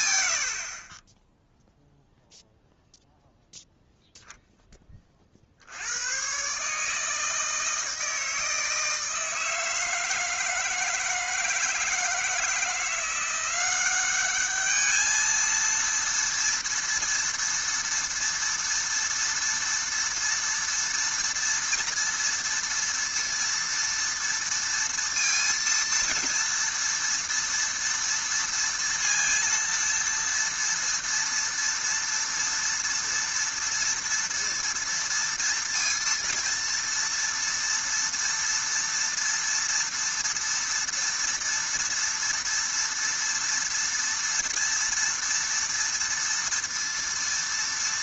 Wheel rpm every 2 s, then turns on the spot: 50, 0, 10, 150, 160, 160, 170, 210, 230, 230, 230, 230, 230, 230, 230, 230, 230, 230, 230, 230, 230, 230, 230, 230.
none